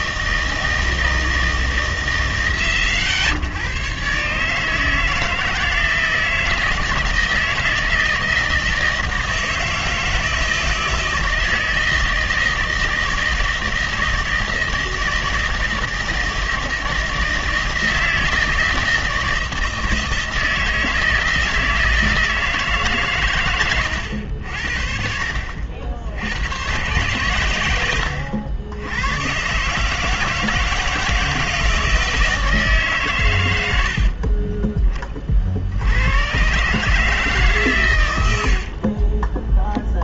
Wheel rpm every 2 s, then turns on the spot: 160, 100, 150, 160, 160, 160, 160, 160, 160, 160, 160, 150, 60, 110, 100, 160, 150, 20, 130, 60.
34-36 38-40